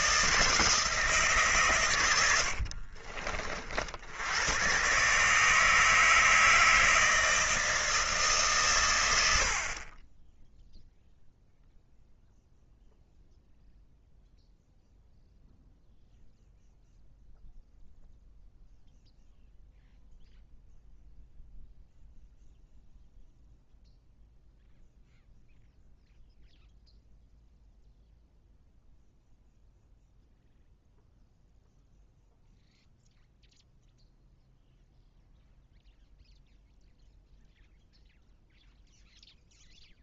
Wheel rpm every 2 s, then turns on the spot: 160, 60, 120, 160, 120, 0, 0, 0, 0, 0, 0, 0, 0, 0, 0, 0, 0, 0, 0, 0.
2-4